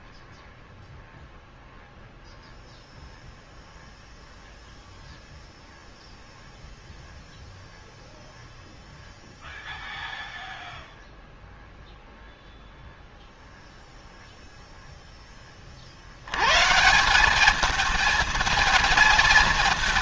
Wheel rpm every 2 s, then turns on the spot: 0, 0, 0, 0, 0, 0, 0, 0, 150, 220.
none